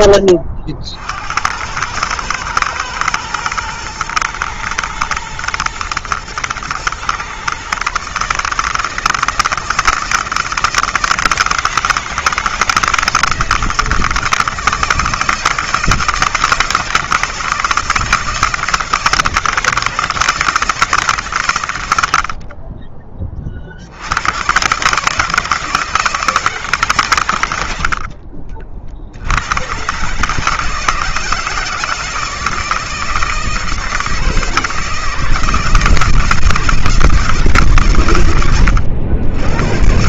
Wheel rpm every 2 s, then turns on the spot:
60, 110, 120, 120, 160, 160, 160, 170, 160, 160, 150, 30, 140, 130, 60, 160, 160, 170, 160, 80.
none